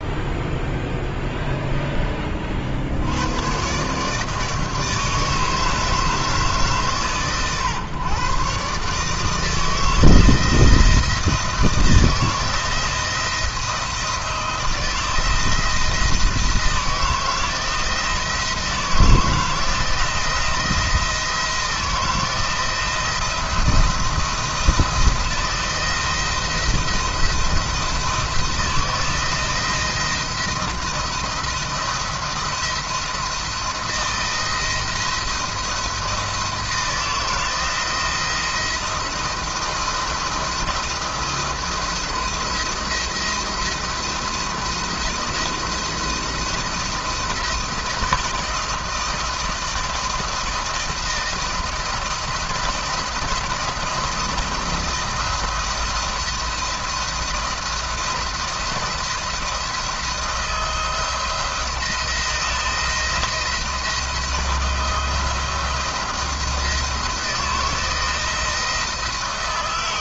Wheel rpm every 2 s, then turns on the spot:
0, 60, 160, 140, 140, 170, 170, 160, 160, 170, 170, 170, 170, 170, 160, 170, 170, 170, 160, 160, 170, 170, 160, 170, 160, 160, 170, 170, 170, 170, 170, 170, 170, 170, 160.
none